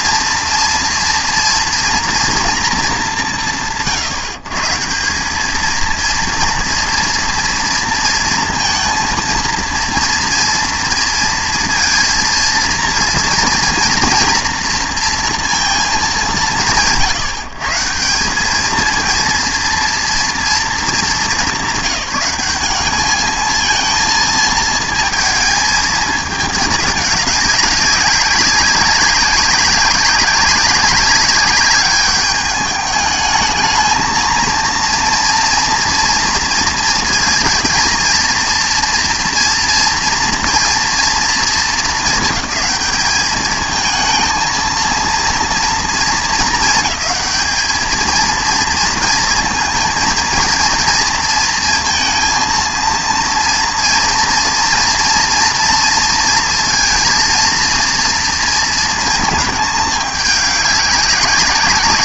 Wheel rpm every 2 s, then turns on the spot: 230, 230, 160, 230, 230, 230, 230, 230, 130, 200, 230, 200, 220, 210, 200, 190, 210, 230, 230, 230, 230, 200, 230, 220, 220, 230, 230, 230, 230, 230, 200.
none